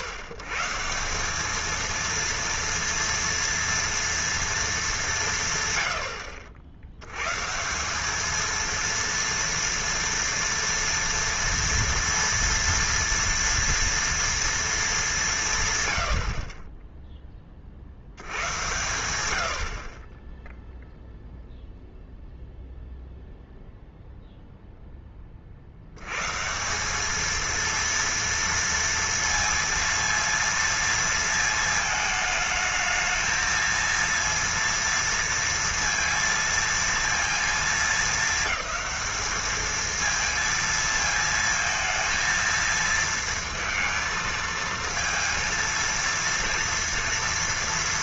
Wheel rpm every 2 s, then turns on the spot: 130, 230, 230, 70, 230, 230, 230, 230, 30, 100, 0, 0, 0, 180, 230, 230, 220, 230, 230, 210, 230, 230, 230, 240.
none